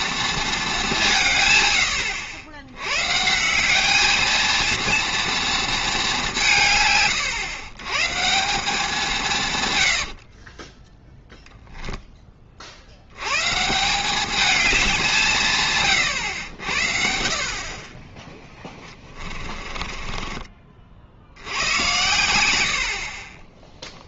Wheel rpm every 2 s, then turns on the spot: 210, 100, 220, 160, 180, 20, 50, 210, 80, 10, 30, 80.
10-12 18-22